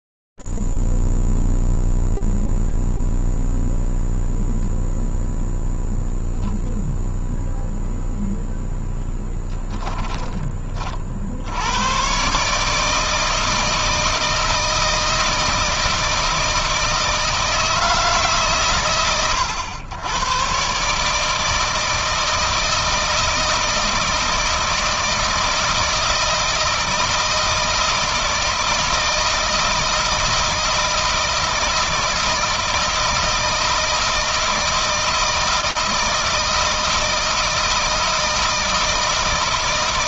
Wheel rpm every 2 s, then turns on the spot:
0, 0, 0, 0, 0, 20, 140, 160, 160, 140, 130, 160, 160, 160, 160, 160, 160, 160, 160, 160.
none